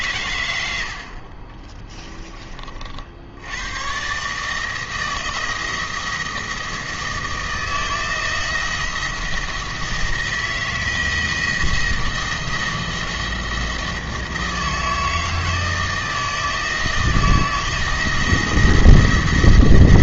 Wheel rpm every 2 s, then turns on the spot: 90, 40, 160, 160, 170, 170, 170, 160, 160, 170.
none